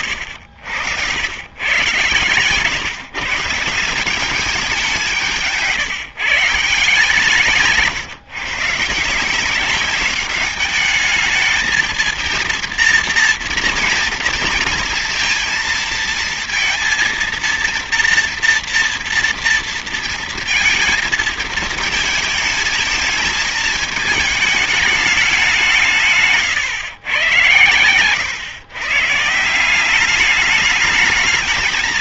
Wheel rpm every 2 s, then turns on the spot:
80, 140, 190, 150, 150, 200, 230, 230, 230, 230, 220, 220, 220, 130, 130, 210.
0-2